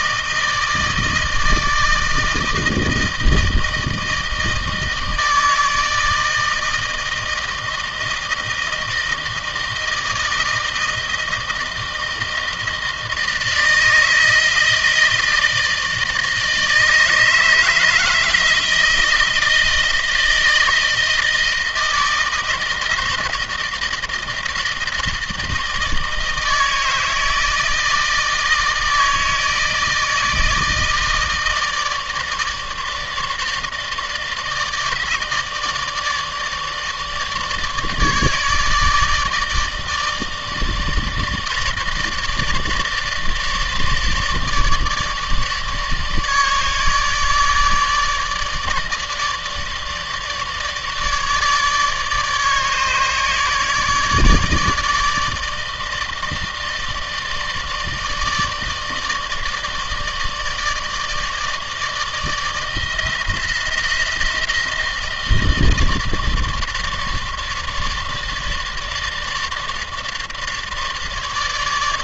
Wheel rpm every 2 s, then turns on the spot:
160, 160, 160, 160, 160, 160, 160, 160, 160, 160, 160, 160, 160, 160, 160, 160, 160, 160, 150, 150, 160, 150, 150, 150, 150, 150, 150, 150, 160, 160, 150, 160, 160, 150, 150, 150.
none